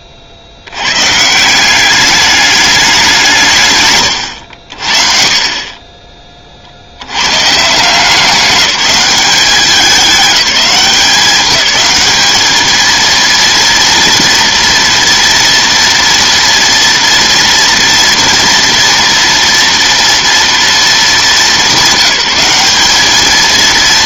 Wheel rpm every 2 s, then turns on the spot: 70, 210, 80, 70, 190, 200, 220, 230, 230, 240, 210, 190.
none